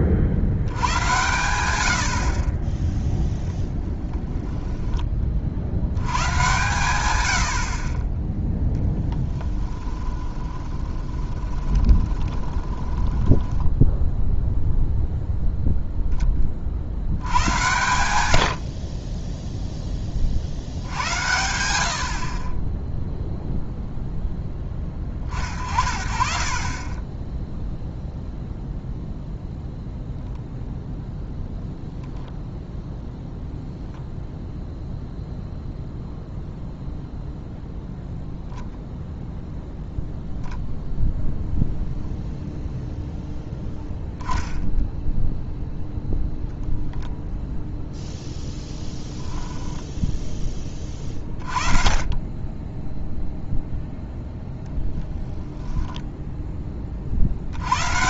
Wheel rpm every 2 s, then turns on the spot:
60, 10, 10, 130, 0, 20, 20, 0, 50, 50, 70, 20, 20, 40, 0, 0, 0, 0, 0, 0, 10, 0, 0, 0, 0, 20, 10, 0, 20.
4-6 10-14